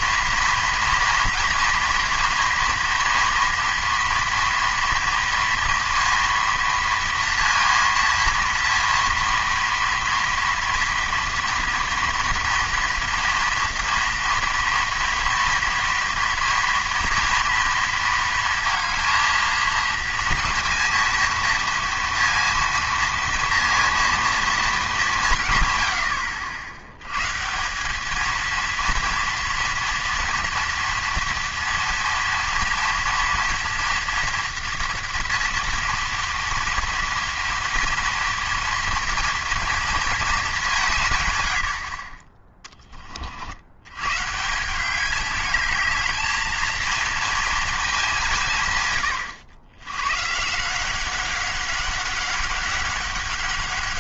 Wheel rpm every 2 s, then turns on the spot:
230, 230, 230, 230, 230, 230, 230, 230, 230, 230, 230, 230, 220, 80, 230, 230, 230, 230, 230, 230, 200, 20, 170, 220, 140, 170, 200.
none